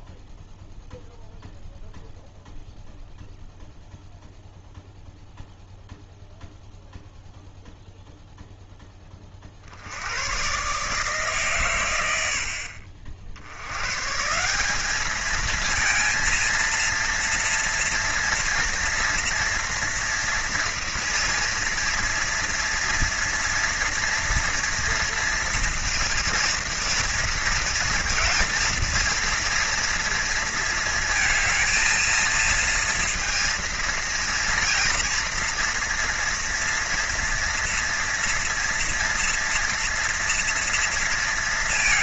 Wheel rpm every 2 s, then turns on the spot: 0, 0, 0, 0, 10, 140, 60, 200, 230, 230, 230, 230, 230, 230, 230, 230, 230, 230, 230, 230, 230.
none